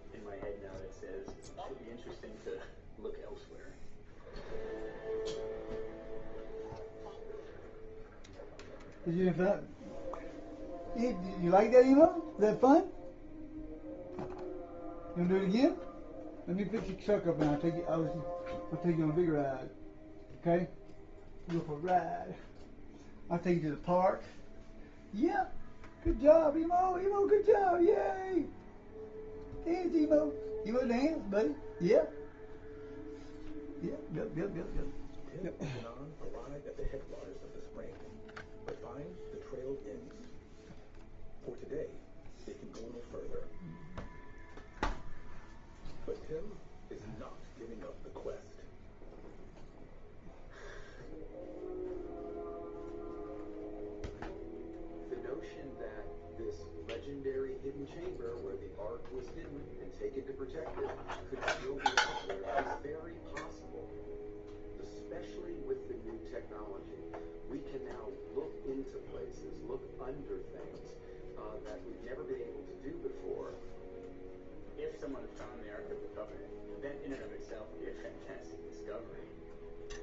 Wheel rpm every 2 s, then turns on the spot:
0, 0, 0, 0, 0, 0, 0, 0, 0, 0, 0, 0, 0, 0, 0, 0, 0, 0, 0, 0, 0, 0, 0, 0, 0, 0, 0, 0, 0, 0, 0, 0, 0, 0, 0, 0, 0, 0, 0, 0.
none